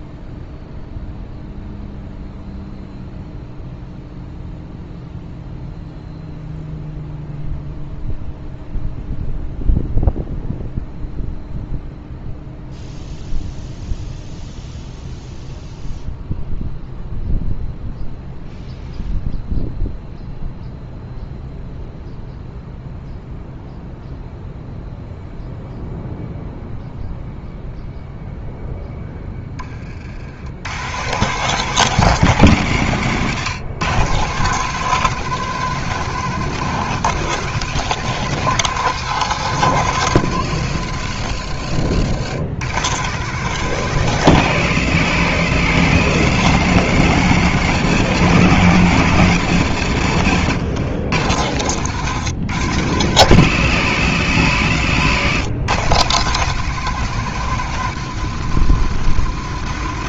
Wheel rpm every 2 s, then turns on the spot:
0, 0, 0, 0, 0, 0, 0, 0, 0, 0, 0, 0, 0, 0, 0, 100, 130, 160, 170, 170, 130, 120, 140, 140, 150, 120, 130, 120, 160, 140.
none